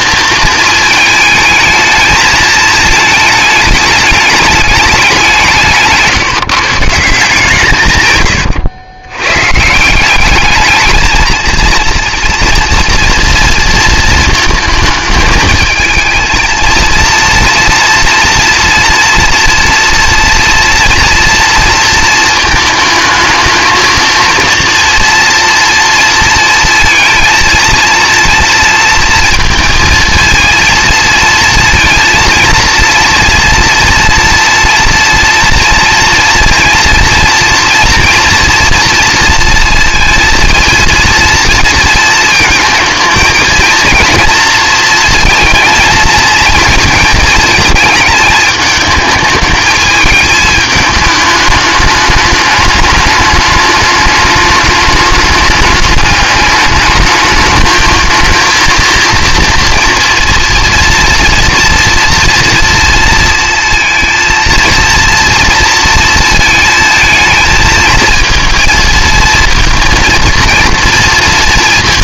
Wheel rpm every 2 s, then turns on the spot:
220, 220, 210, 160, 100, 210, 230, 220, 230, 230, 230, 220, 230, 230, 230, 230, 230, 230, 230, 230, 230, 220, 230, 230, 220, 220, 210, 210, 210, 230, 230, 230, 230, 220, 230, 240.
none